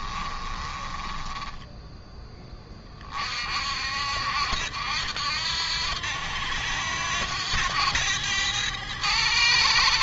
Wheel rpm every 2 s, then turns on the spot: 20, 30, 80, 90, 100.
0-2